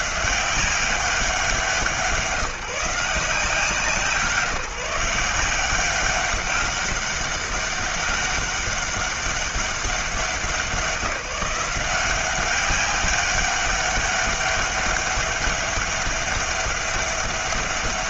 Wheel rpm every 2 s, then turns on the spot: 190, 170, 180, 200, 200, 180, 190, 200, 200.
none